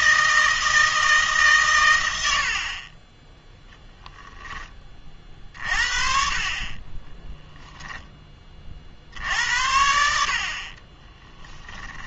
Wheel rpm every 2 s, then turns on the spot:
160, 50, 20, 30, 40, 40.
10-12